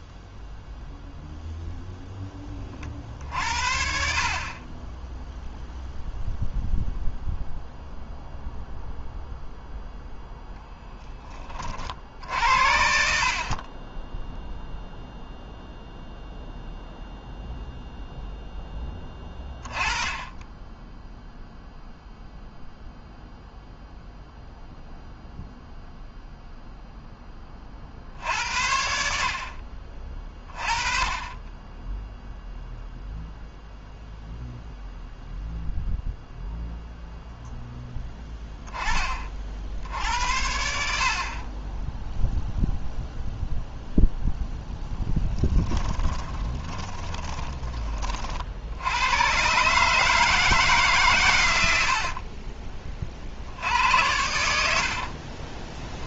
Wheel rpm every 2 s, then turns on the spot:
0, 20, 40, 0, 0, 0, 60, 10, 0, 0, 10, 0, 0, 0, 60, 30, 0, 0, 0, 10, 80, 0, 0, 10, 50, 150, 30, 90.
46-48 52-56